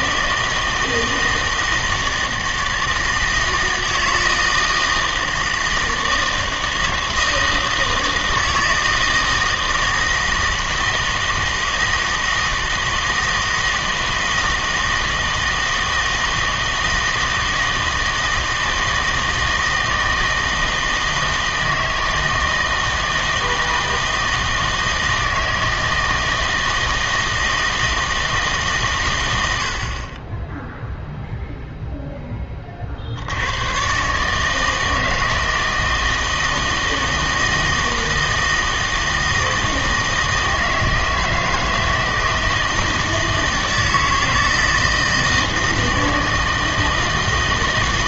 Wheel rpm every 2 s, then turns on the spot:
160, 160, 160, 160, 160, 160, 160, 160, 160, 160, 160, 160, 160, 160, 140, 0, 30, 160, 160, 160, 160, 160, 160, 160.
none